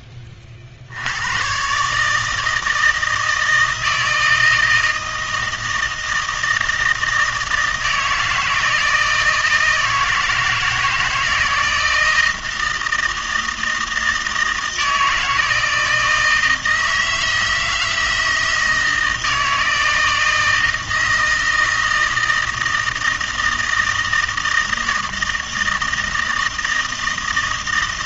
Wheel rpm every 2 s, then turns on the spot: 60, 160, 160, 160, 160, 160, 160, 160, 160, 160, 160, 160, 160, 160.
none